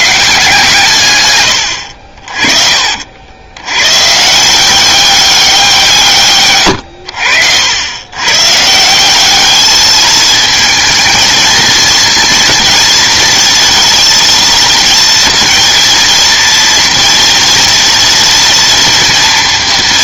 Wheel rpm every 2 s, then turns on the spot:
160, 40, 180, 100, 160, 220, 230, 230, 230, 230.
none